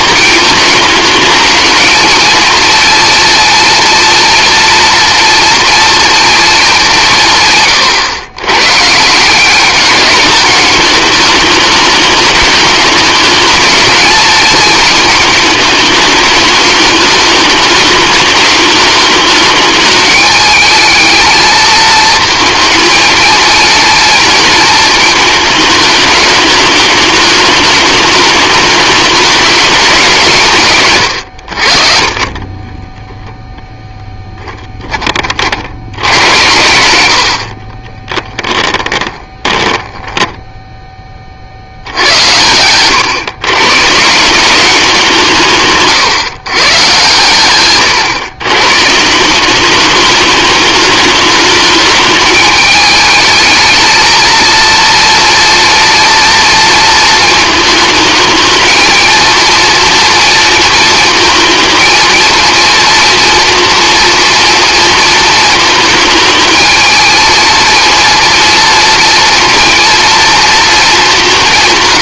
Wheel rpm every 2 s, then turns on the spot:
210, 230, 230, 190, 140, 210, 210, 220, 210, 210, 220, 220, 220, 210, 210, 130, 10, 20, 90, 10, 10, 110, 180, 130, 140, 210, 210, 230, 230, 220, 220, 230, 230, 220, 230, 220.
32-34 38-40